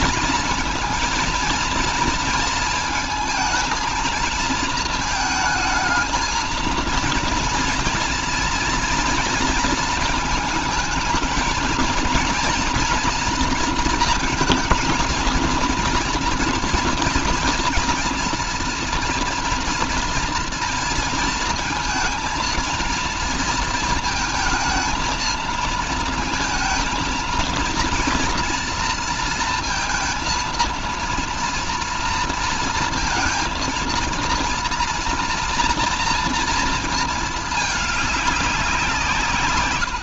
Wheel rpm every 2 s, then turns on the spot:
230, 220, 220, 230, 240, 220, 230, 230, 240, 240, 230, 230, 230, 230, 240, 230, 230, 230, 230, 180.
none